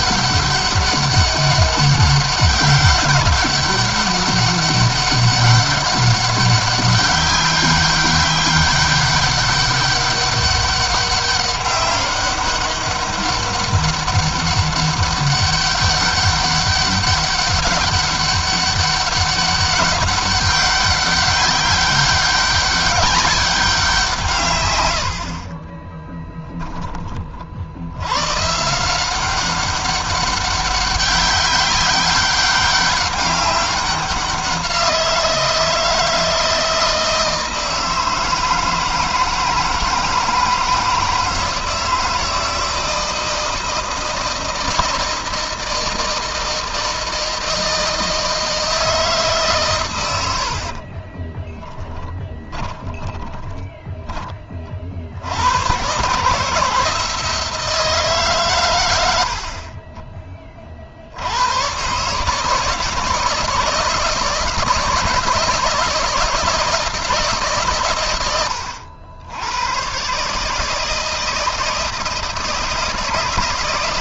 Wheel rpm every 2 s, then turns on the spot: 200, 200, 200, 190, 200, 200, 200, 200, 200, 200, 200, 200, 80, 30, 180, 200, 200, 170, 160, 160, 160, 160, 160, 160, 150, 30, 20, 60, 160, 100, 80, 160, 160, 160, 100, 160, 160.
50-54